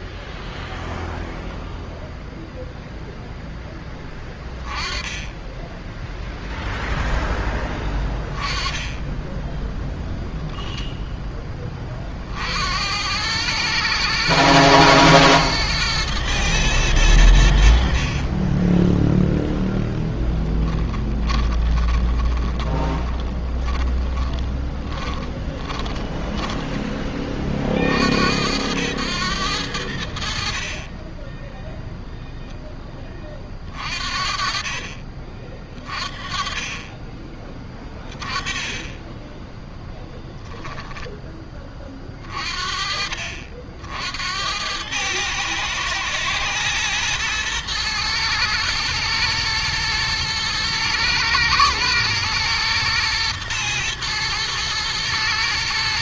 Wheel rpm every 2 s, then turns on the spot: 0, 0, 20, 0, 20, 0, 70, 120, 110, 20, 10, 20, 10, 10, 90, 30, 10, 30, 20, 30, 0, 40, 100, 120, 110, 110, 110, 110.
20-26 30-32